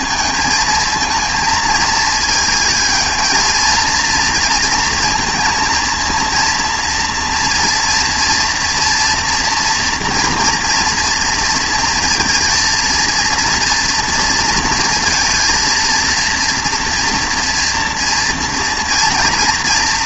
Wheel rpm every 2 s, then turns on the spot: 220, 220, 230, 230, 230, 230, 230, 230, 230, 230.
none